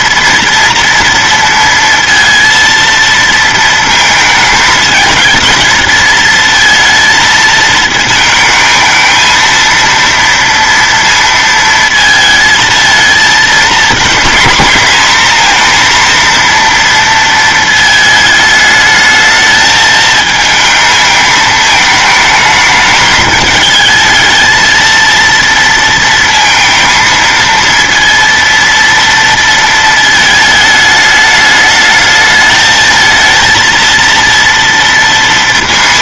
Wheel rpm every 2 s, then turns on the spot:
230, 230, 220, 230, 220, 230, 220, 230, 230, 220, 220, 220, 220, 230, 230, 210, 220, 230.
none